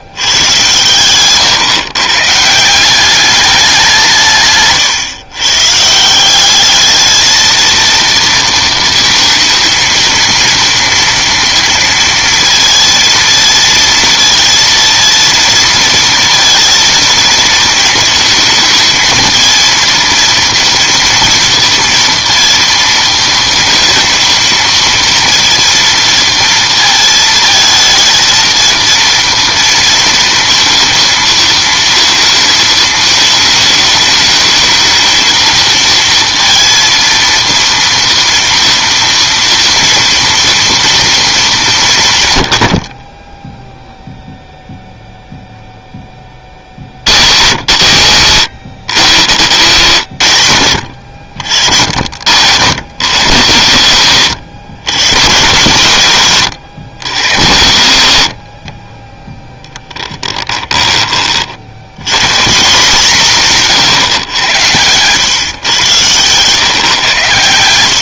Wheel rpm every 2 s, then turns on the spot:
120, 180, 130, 210, 230, 230, 230, 230, 230, 220, 230, 230, 230, 230, 230, 230, 220, 220, 230, 230, 230, 50, 0, 80, 120, 100, 90, 110, 90, 20, 20, 170, 110, 130.
58-60